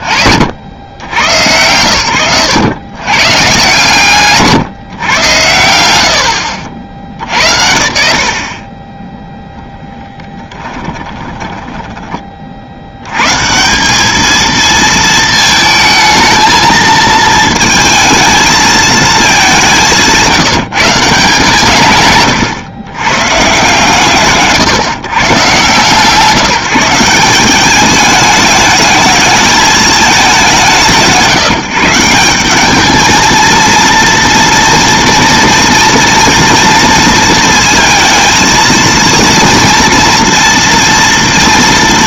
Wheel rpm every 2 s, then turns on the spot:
20, 110, 140, 110, 60, 10, 30, 220, 220, 230, 180, 140, 140, 140, 210, 200, 180, 230, 230, 230, 230.
10-12